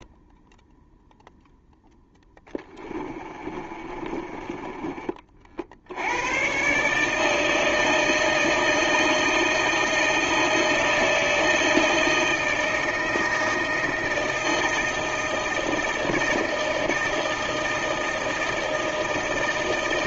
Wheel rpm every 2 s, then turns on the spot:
0, 20, 30, 150, 160, 160, 160, 160, 160, 160.
2-6